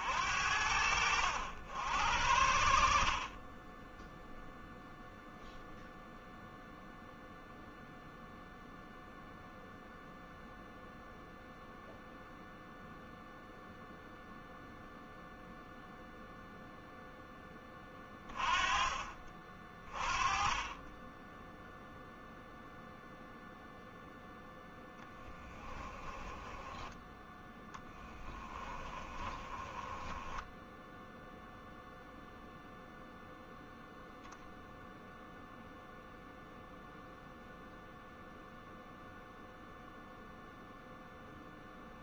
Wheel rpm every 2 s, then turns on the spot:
70, 50, 0, 0, 0, 0, 0, 0, 0, 30, 10, 0, 0, 10, 20, 0, 0, 0, 0, 0, 0.
28-30